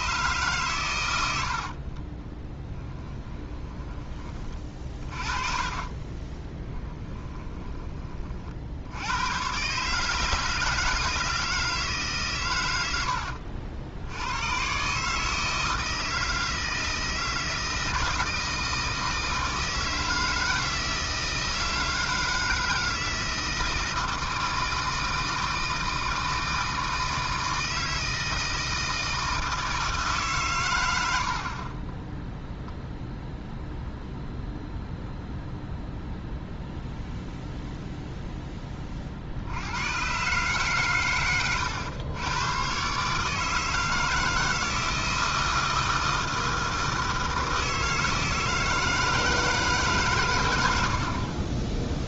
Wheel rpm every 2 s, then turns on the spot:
120, 10, 30, 10, 60, 160, 110, 130, 160, 160, 160, 160, 160, 160, 160, 120, 0, 0, 0, 20, 130, 120, 160, 160, 160, 100.
2-8